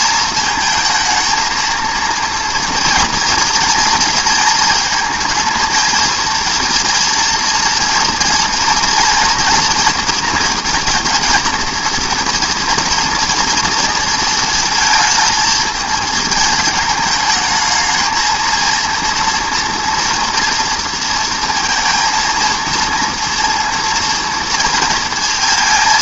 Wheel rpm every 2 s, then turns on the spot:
220, 240, 230, 230, 230, 240, 230, 220, 220, 230, 230, 230, 230.
none